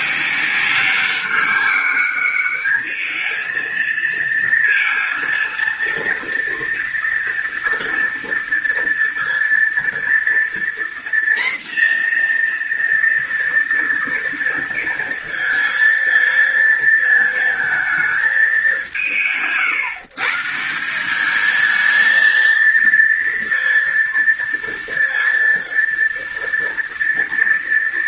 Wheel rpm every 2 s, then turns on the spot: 190, 210, 230, 230, 230, 240, 240, 230, 230, 210, 160, 230, 230, 230.
none